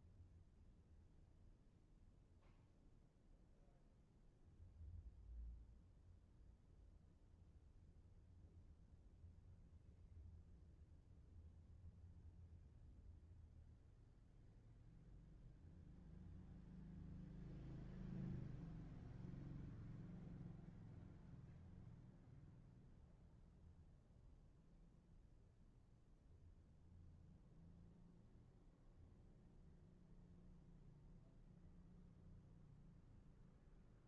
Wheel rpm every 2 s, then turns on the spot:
0, 0, 0, 0, 0, 0, 0, 0, 0, 0, 0, 0, 0, 0, 0, 0, 0.
none